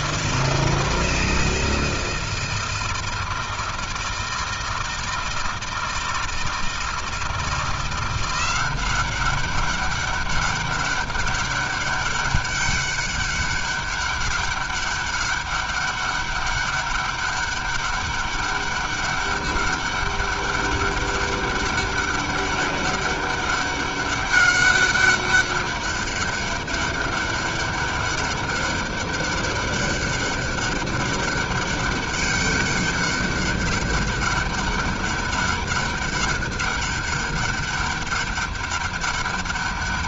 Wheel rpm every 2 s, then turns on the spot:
160, 160, 160, 160, 180, 200, 200, 200, 200, 200, 200, 200, 200, 200, 200, 200, 200, 200, 200, 200.
none